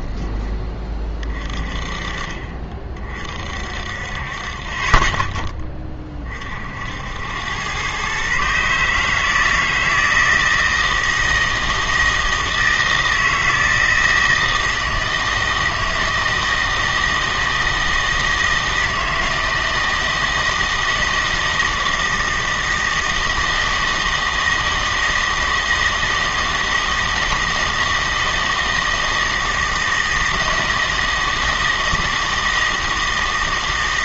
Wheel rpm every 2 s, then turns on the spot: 20, 30, 30, 60, 140, 160, 160, 160, 160, 160, 160, 160, 160, 160, 160, 160, 160.
none